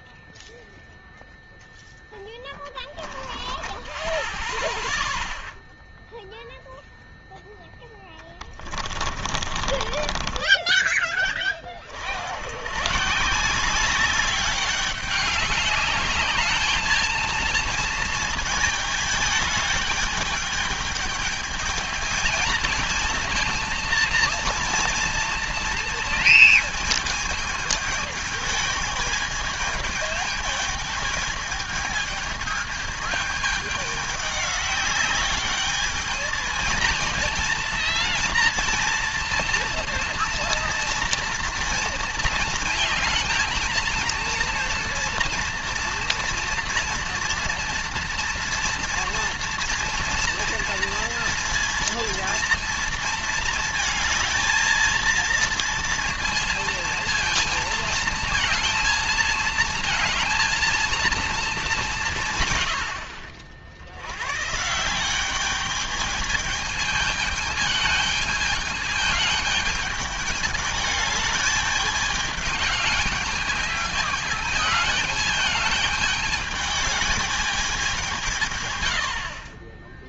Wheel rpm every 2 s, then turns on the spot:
0, 10, 0, 0, 30, 30, 120, 200, 220, 220, 210, 230, 230, 220, 220, 220, 220, 200, 230, 230, 230, 230, 230, 230, 230, 230, 230, 220, 230, 220, 230, 100, 170, 220, 210, 210, 210, 220, 210, 90.
2-4 8-10